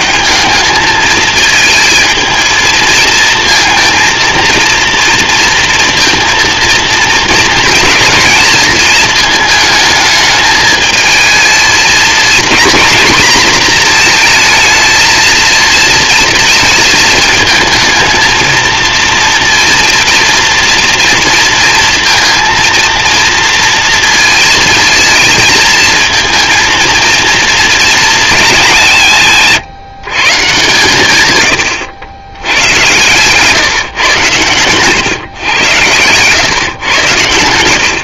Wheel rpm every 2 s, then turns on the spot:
100, 220, 230, 230, 230, 220, 220, 230, 230, 220, 240, 230, 230, 230, 220, 150, 100, 130, 110.
32-34